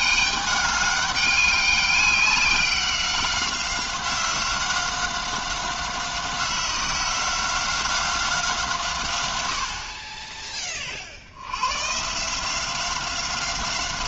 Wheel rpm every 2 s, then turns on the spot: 200, 190, 190, 180, 160, 30, 180.
none